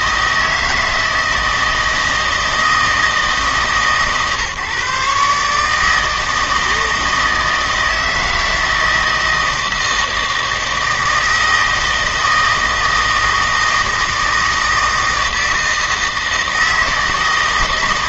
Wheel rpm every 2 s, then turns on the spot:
160, 160, 150, 160, 160, 160, 160, 160, 160.
none